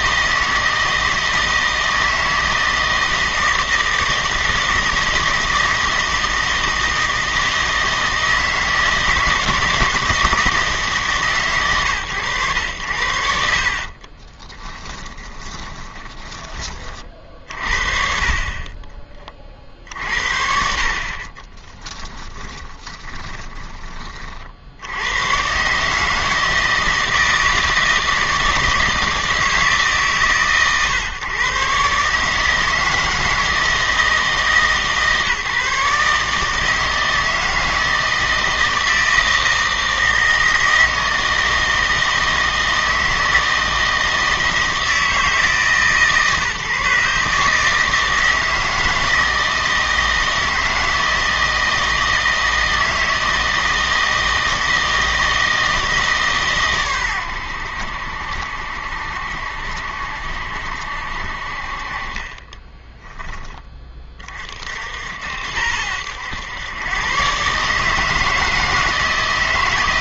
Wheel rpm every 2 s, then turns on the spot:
160, 160, 160, 160, 160, 160, 110, 20, 30, 20, 50, 20, 70, 160, 160, 140, 160, 150, 160, 160, 160, 160, 160, 140, 160, 160, 160, 160, 130, 70, 70, 10, 50, 110, 160.
14-16 22-24